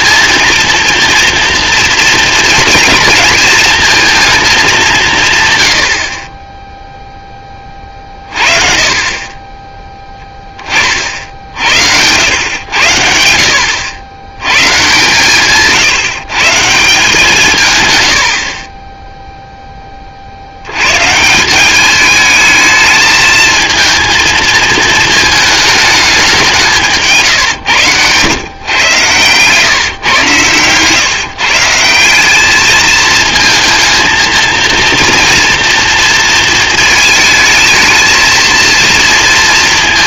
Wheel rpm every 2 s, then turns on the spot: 230, 230, 200, 10, 40, 30, 90, 110, 160, 30, 90, 220, 220, 170, 120, 120, 210, 230, 230, 230.
none